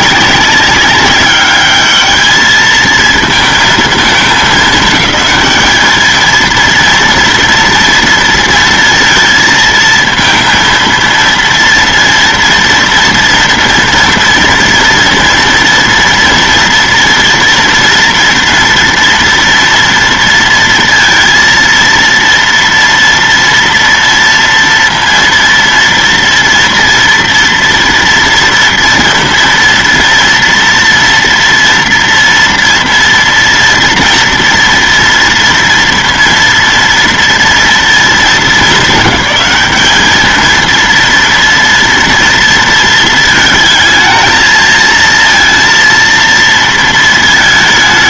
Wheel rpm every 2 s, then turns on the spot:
200, 220, 220, 230, 230, 230, 230, 240, 230, 240, 230, 230, 230, 230, 230, 230, 230, 230, 230, 200, 220, 230, 220, 230.
none